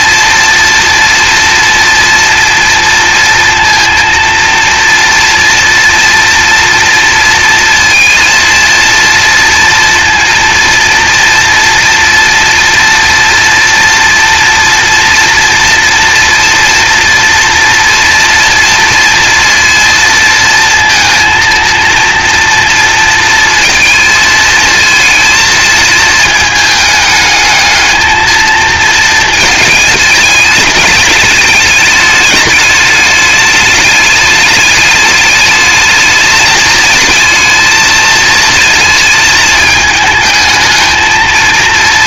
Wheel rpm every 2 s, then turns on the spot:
230, 230, 230, 230, 230, 230, 230, 230, 230, 230, 230, 230, 230, 220, 230, 210, 210, 210, 210, 220, 220.
none